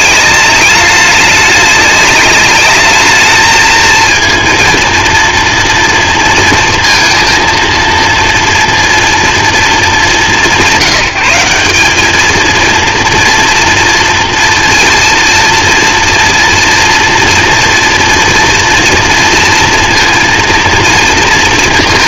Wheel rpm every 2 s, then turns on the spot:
210, 210, 230, 230, 240, 170, 230, 230, 230, 230, 230.
none